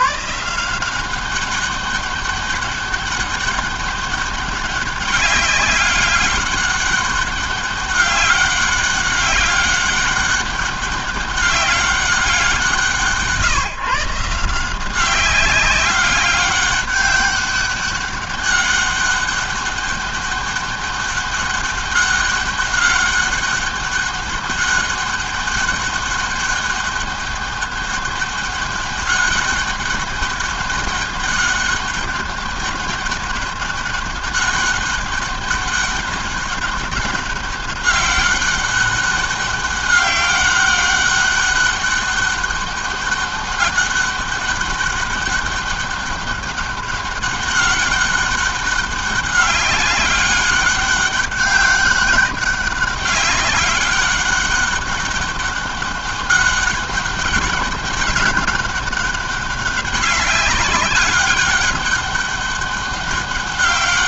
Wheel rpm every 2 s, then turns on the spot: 190, 200, 200, 200, 200, 200, 170, 180, 190, 200, 200, 200, 200, 200, 200, 200, 200, 200, 200, 200, 200, 200, 200, 200, 200, 200, 200, 200, 200, 200, 200, 200.
none